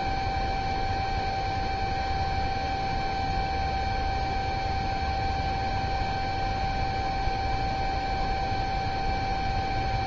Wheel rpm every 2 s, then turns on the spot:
0, 0, 0, 0, 0.
none